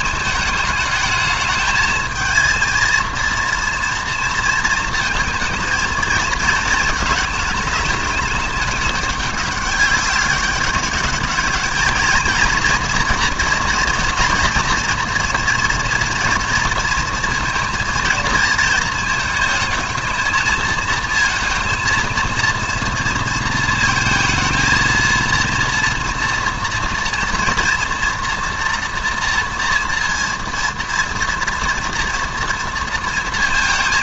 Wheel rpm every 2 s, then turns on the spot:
210, 230, 230, 220, 210, 200, 240, 230, 230, 220, 220, 230, 230, 230, 230, 240, 230.
none